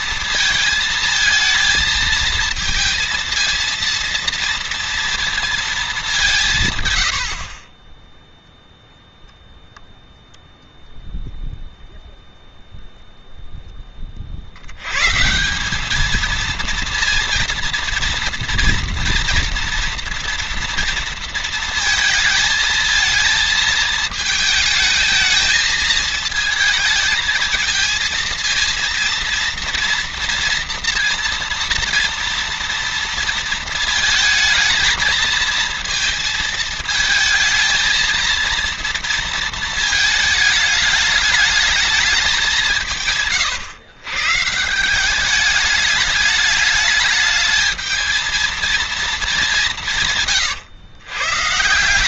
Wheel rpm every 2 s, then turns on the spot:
220, 230, 230, 130, 0, 0, 0, 100, 230, 230, 230, 220, 220, 220, 230, 230, 230, 220, 220, 230, 210, 170, 170, 210, 220, 110.
none